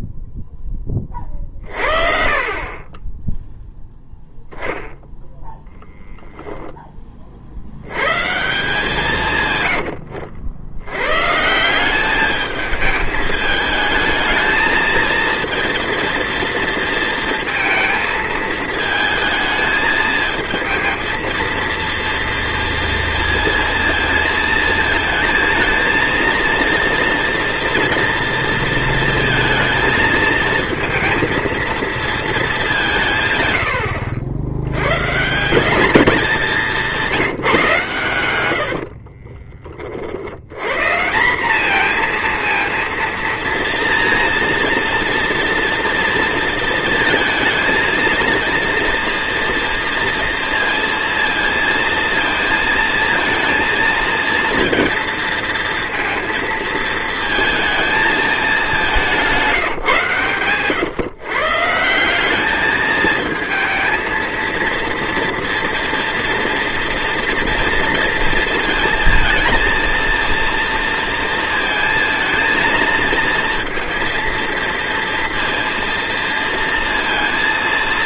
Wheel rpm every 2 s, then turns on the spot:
10, 30, 0, 0, 160, 80, 210, 220, 230, 220, 220, 230, 230, 230, 230, 220, 200, 100, 200, 80, 100, 230, 230, 230, 230, 230, 230, 230, 220, 200, 130, 210, 230, 240, 230, 230, 230, 230, 230.
none